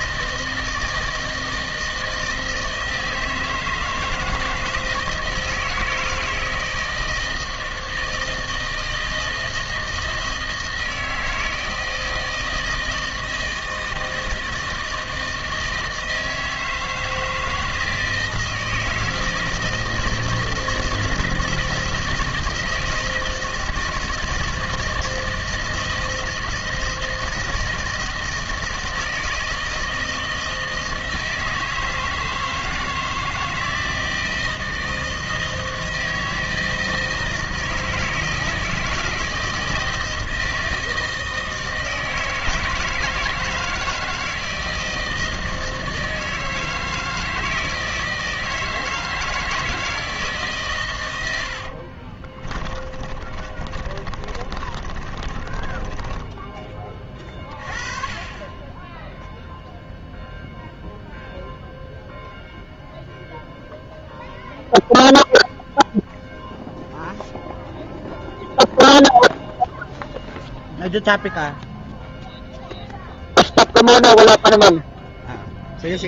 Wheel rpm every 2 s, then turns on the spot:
160, 160, 160, 160, 160, 160, 160, 160, 160, 160, 160, 160, 160, 160, 160, 160, 160, 160, 160, 160, 160, 160, 160, 160, 160, 110, 30, 20, 20, 10, 0, 0, 0, 0, 0, 0, 0, 0.
52-56